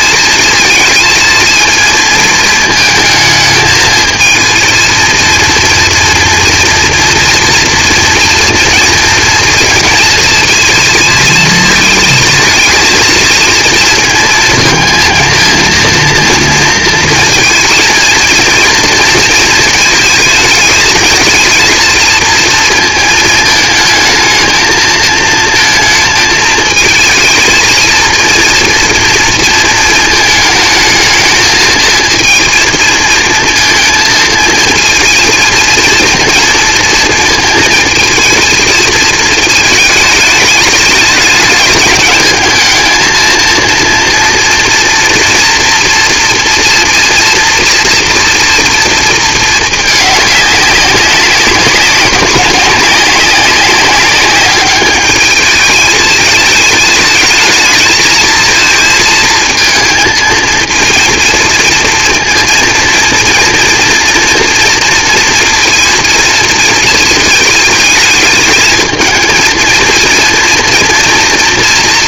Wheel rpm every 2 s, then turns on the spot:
220, 230, 220, 230, 230, 230, 230, 230, 230, 230, 220, 230, 220, 220, 230, 220, 230, 230, 230, 230, 220, 220, 230, 230, 230, 200, 200, 210, 220, 230, 220, 230, 230, 230, 220, 230.
none